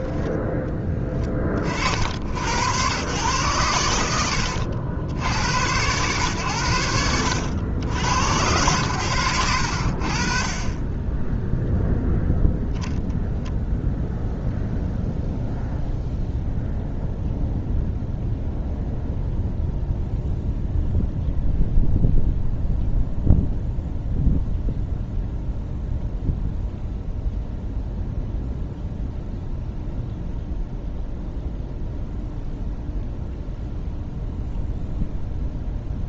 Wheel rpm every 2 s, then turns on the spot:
10, 100, 80, 90, 100, 20, 0, 0, 0, 0, 0, 0, 0, 0, 0, 0, 0, 0.
none